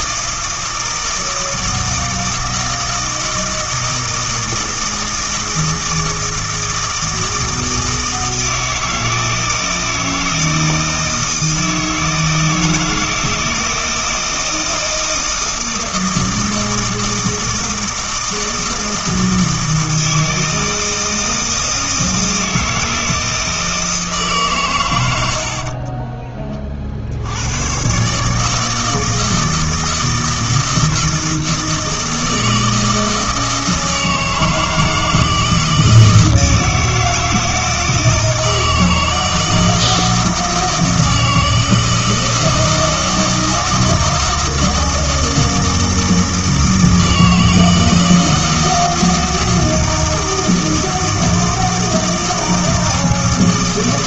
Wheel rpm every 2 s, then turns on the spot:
160, 160, 160, 160, 160, 160, 160, 160, 160, 160, 160, 160, 120, 40, 160, 160, 160, 160, 160, 160, 160, 160, 160, 160, 160, 160, 160.
none